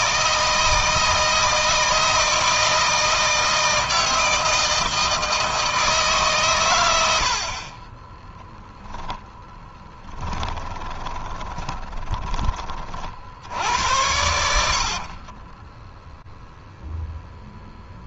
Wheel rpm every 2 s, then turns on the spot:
160, 160, 160, 110, 0, 20, 40, 60, 0.
10-12 14-16